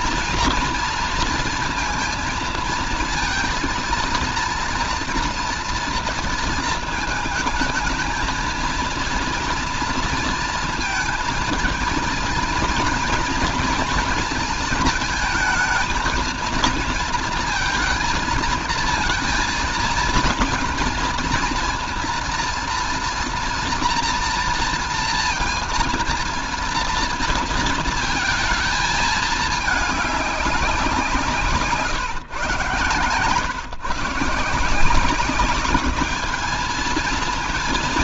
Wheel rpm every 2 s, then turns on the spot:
230, 230, 230, 230, 220, 230, 230, 230, 230, 220, 230, 230, 230, 230, 230, 200, 130, 160, 200.
none